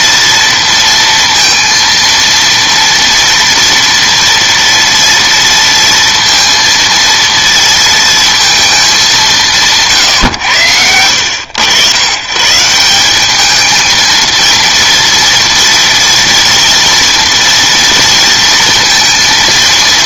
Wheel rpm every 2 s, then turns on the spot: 230, 240, 230, 230, 220, 100, 150, 230, 230, 230.
none